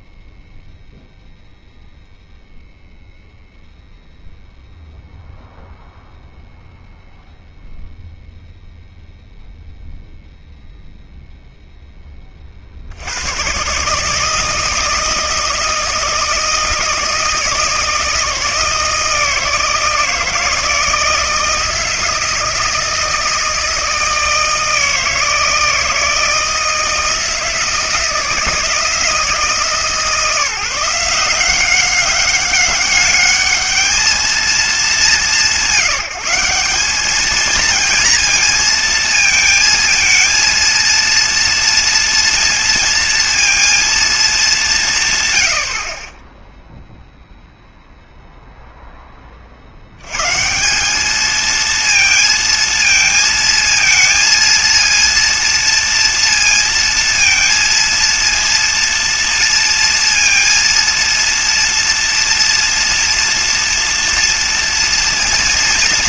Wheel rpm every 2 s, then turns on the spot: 0, 0, 0, 0, 0, 0, 60, 160, 160, 160, 160, 160, 160, 160, 160, 160, 200, 220, 210, 230, 230, 230, 170, 0, 0, 180, 230, 230, 230, 230, 230, 230, 230.
none